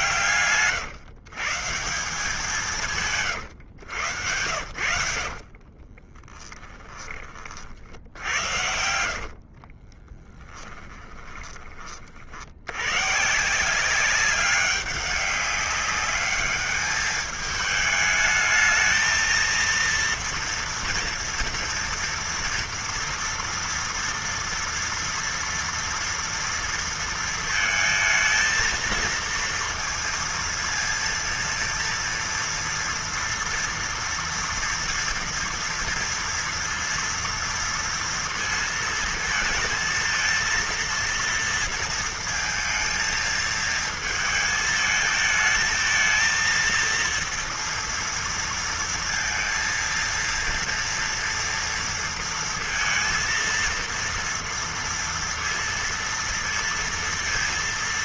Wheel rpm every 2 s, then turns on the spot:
140, 180, 90, 10, 80, 10, 80, 200, 210, 220, 230, 230, 230, 230, 230, 230, 230, 230, 230, 230, 230, 220, 220, 230, 230, 230, 230, 230, 230.
4-12